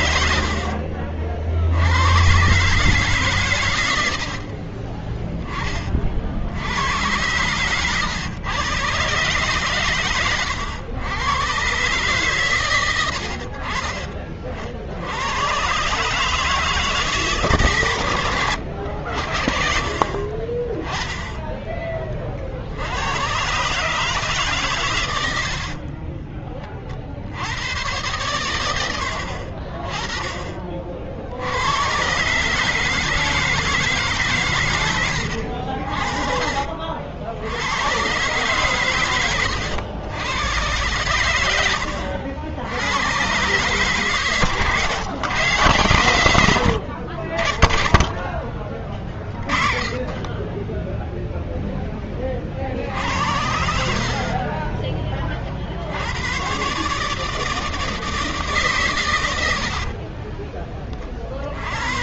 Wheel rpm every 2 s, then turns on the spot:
70, 130, 60, 70, 120, 120, 130, 40, 150, 110, 40, 50, 150, 30, 100, 30, 140, 140, 50, 130, 110, 90, 140, 100, 20, 20, 40, 30, 120, 160, 20.
4-6 26-28